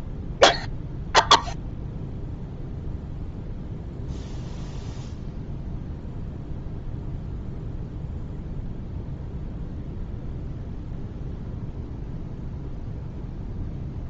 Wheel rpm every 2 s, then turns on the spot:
0, 0, 0, 0, 0, 0, 0.
none